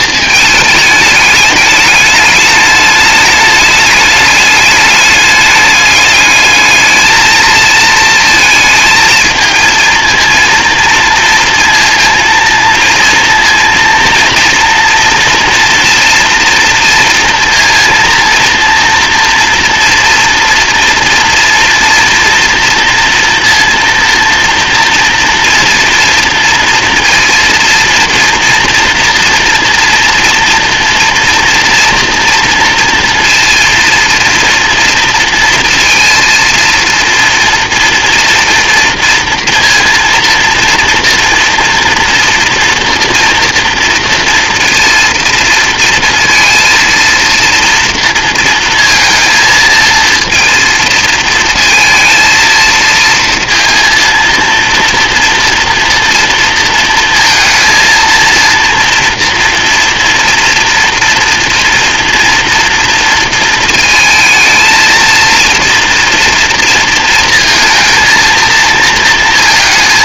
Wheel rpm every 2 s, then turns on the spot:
220, 210, 210, 220, 230, 230, 230, 230, 240, 240, 230, 240, 230, 230, 230, 240, 230, 230, 230, 230, 230, 230, 230, 230, 230, 230, 230, 230, 230, 230, 230, 230, 220, 230, 230.
none